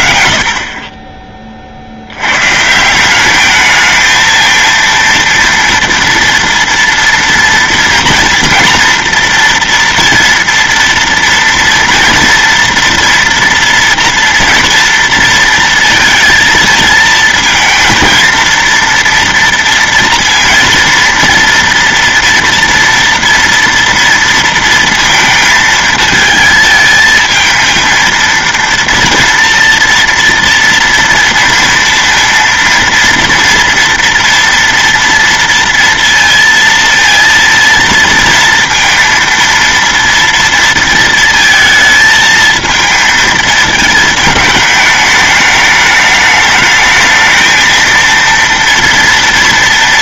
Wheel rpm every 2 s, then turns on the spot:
30, 160, 230, 230, 240, 240, 240, 240, 230, 230, 230, 230, 230, 220, 230, 230, 230, 230, 230, 230, 230, 220, 210, 220, 230.
none